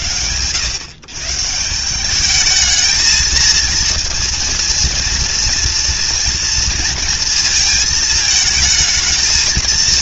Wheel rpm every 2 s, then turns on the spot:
140, 230, 230, 230, 200.
none